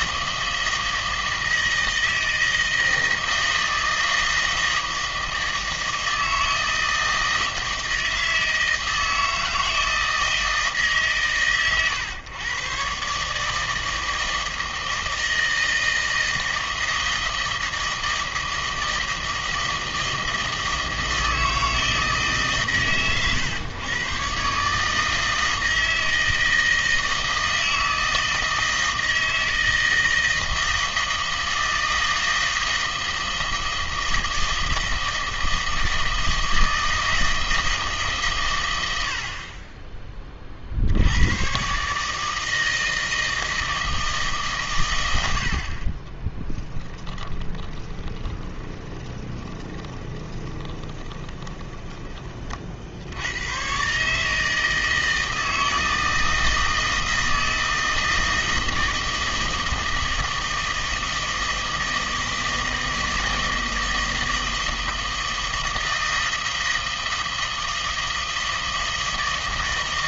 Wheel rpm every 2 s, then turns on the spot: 160, 160, 160, 160, 160, 160, 120, 160, 160, 160, 160, 140, 140, 160, 160, 160, 160, 160, 160, 110, 50, 160, 130, 20, 20, 20, 50, 160, 160, 160, 160, 160, 160, 160, 160.
46-52